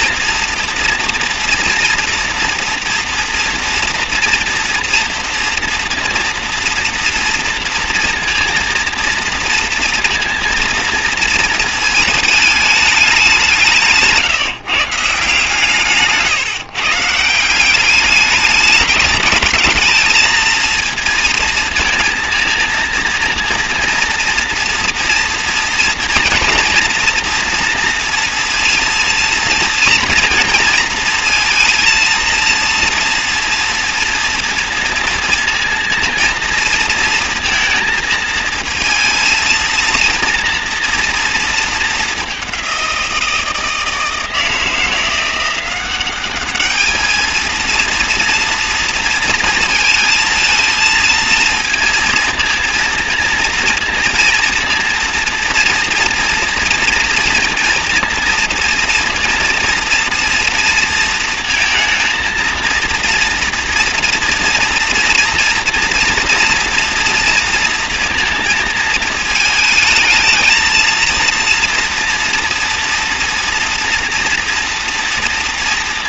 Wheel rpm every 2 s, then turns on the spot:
230, 230, 230, 230, 230, 230, 210, 150, 150, 210, 220, 230, 230, 240, 230, 230, 230, 230, 230, 230, 230, 180, 170, 220, 230, 220, 230, 230, 230, 230, 230, 230, 230, 230, 220, 230, 230, 230.
none